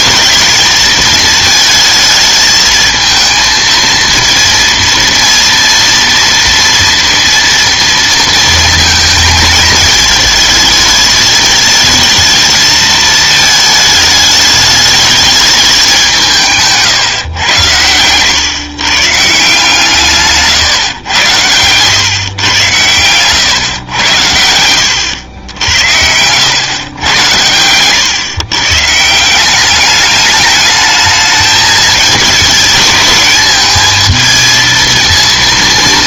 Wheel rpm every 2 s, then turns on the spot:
220, 220, 230, 230, 230, 220, 220, 210, 150, 120, 140, 130, 90, 110, 140, 210, 210, 230.
20-22